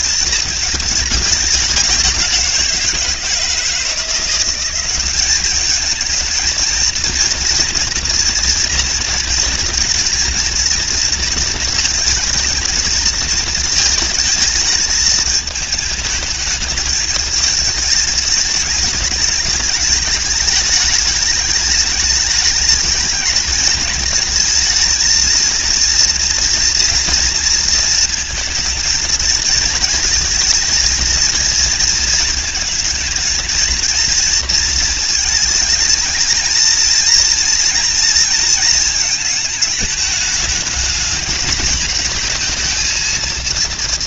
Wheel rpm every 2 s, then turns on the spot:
210, 160, 210, 230, 230, 230, 220, 220, 220, 210, 210, 220, 230, 230, 230, 230, 220, 220, 230, 210, 220, 230.
none